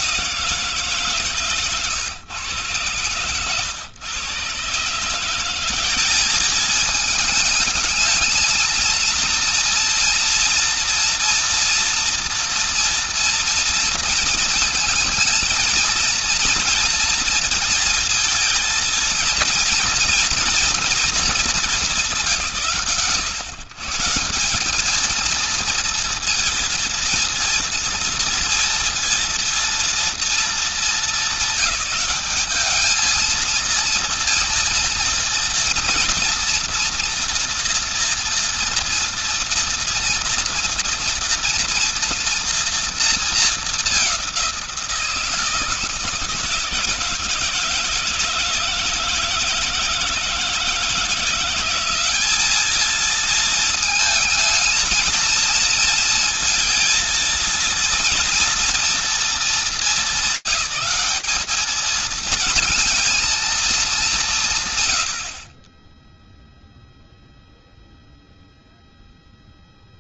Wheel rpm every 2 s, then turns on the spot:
170, 120, 130, 200, 230, 230, 230, 230, 230, 230, 240, 150, 150, 230, 230, 230, 210, 230, 240, 230, 230, 230, 200, 160, 160, 160, 200, 220, 230, 230, 220, 220, 200, 20, 0.
none